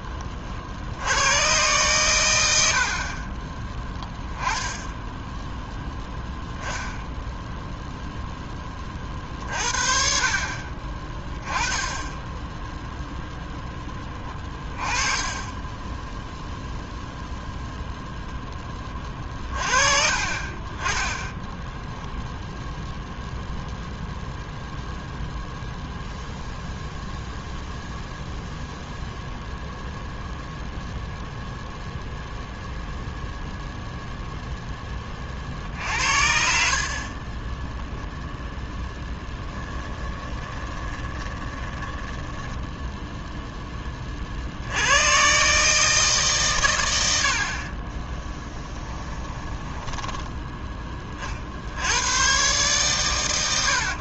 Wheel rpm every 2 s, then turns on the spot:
60, 70, 10, 0, 20, 40, 0, 20, 0, 20, 20, 0, 0, 0, 0, 0, 0, 10, 50, 0, 20, 10, 80, 110, 10, 20, 130.
2-4 14-16 40-44 48-50